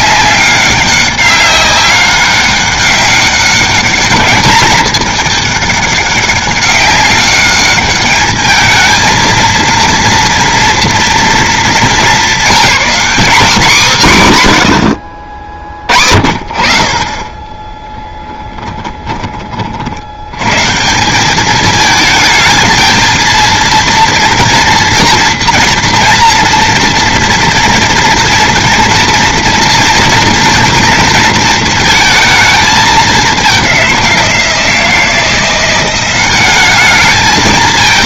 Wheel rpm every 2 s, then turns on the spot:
190, 200, 210, 200, 220, 230, 220, 90, 40, 10, 130, 220, 230, 230, 230, 230, 220, 170, 200.
none